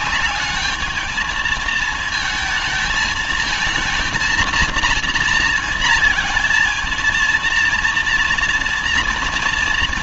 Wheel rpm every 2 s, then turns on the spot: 210, 230, 240, 230, 230.
none